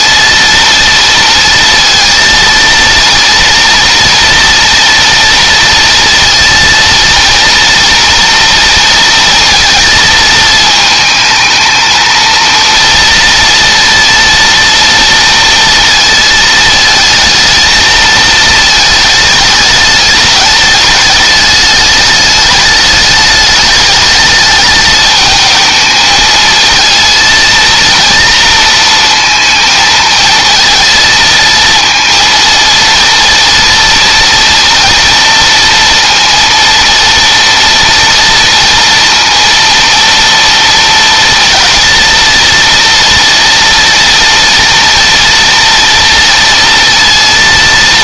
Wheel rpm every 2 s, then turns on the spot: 230, 230, 230, 230, 230, 220, 230, 230, 220, 220, 210, 210, 220, 230, 230, 220, 230, 230, 230, 230, 230, 230, 230, 230.
none